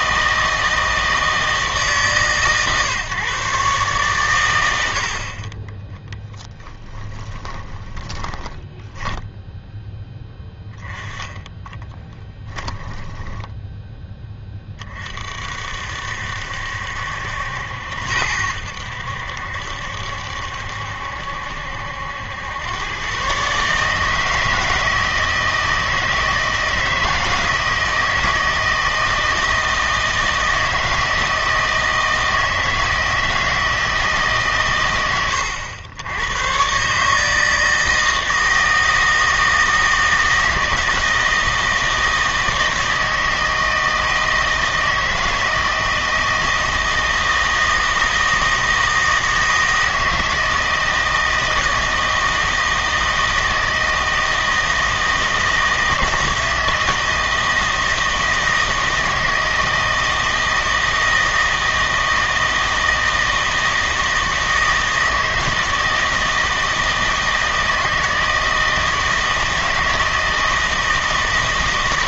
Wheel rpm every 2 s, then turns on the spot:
160, 140, 100, 10, 10, 10, 10, 20, 70, 80, 70, 100, 160, 160, 160, 160, 160, 120, 130, 160, 160, 160, 160, 160, 160, 160, 160, 160, 160, 160, 160, 160, 160, 160, 160, 160.
6-10 12-14